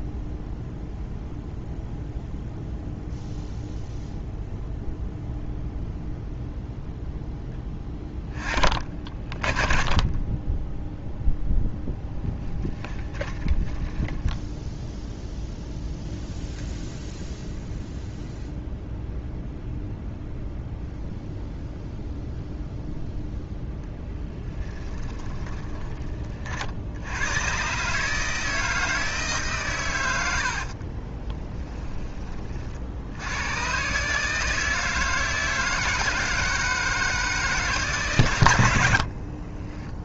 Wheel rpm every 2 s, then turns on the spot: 0, 0, 0, 0, 40, 10, 20, 0, 0, 0, 0, 0, 10, 70, 160, 50, 60, 160, 160, 70.
12-14 24-26 30-32